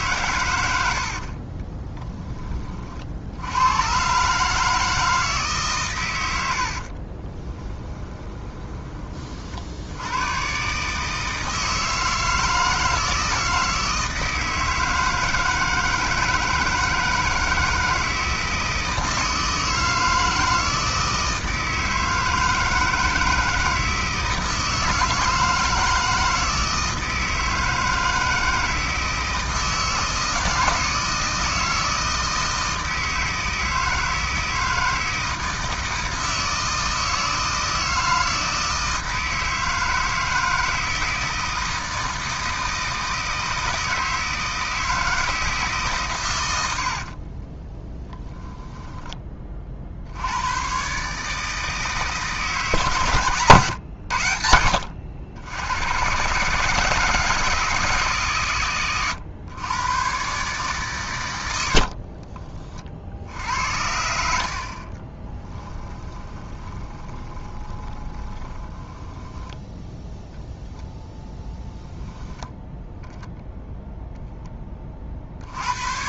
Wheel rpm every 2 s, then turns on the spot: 50, 70, 160, 30, 40, 160, 160, 160, 160, 160, 160, 160, 160, 160, 160, 160, 160, 160, 160, 160, 160, 160, 160, 110, 10, 110, 150, 90, 150, 130, 140, 40, 60, 20, 20, 0, 0, 10.
0-2 6-8 48-50 66-70